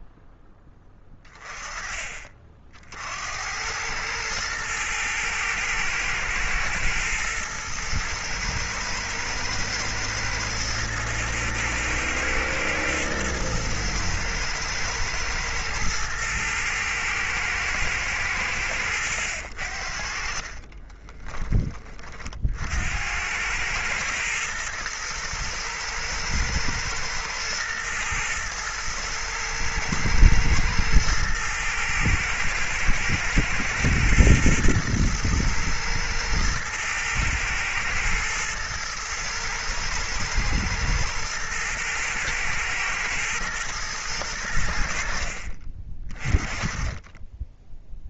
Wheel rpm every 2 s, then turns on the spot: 10, 80, 110, 110, 120, 110, 110, 110, 110, 80, 20, 90, 110, 110, 110, 110, 120, 120, 110, 110, 110, 110, 70, 30.
none